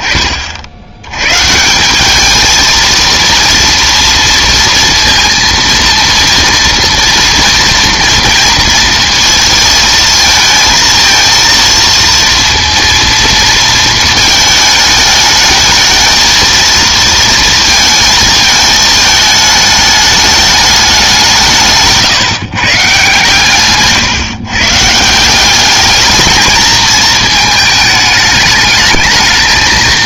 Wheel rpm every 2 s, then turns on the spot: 30, 210, 230, 230, 240, 230, 230, 220, 230, 220, 210, 160, 140, 210, 220.
none